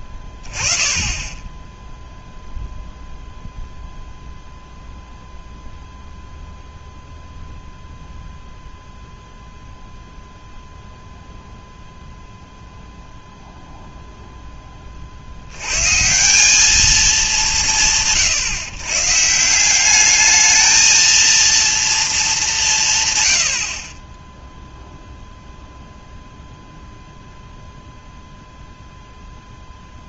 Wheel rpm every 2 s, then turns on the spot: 20, 0, 0, 0, 0, 0, 0, 20, 200, 130, 220, 160, 0, 0, 0.
none